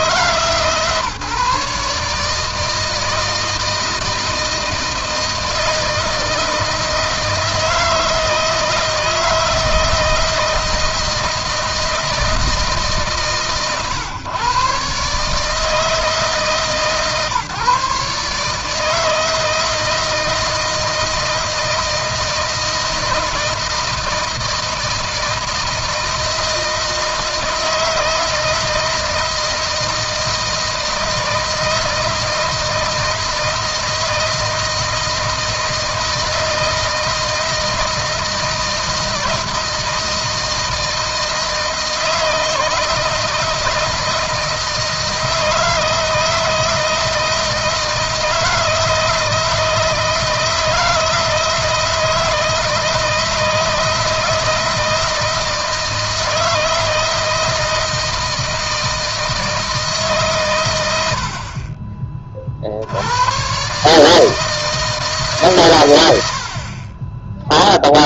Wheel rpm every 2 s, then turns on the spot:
150, 160, 160, 160, 160, 160, 150, 140, 140, 160, 160, 160, 160, 160, 160, 160, 160, 160, 160, 160, 160, 160, 160, 160, 160, 160, 160, 160, 160, 160, 70, 80, 150, 40.
none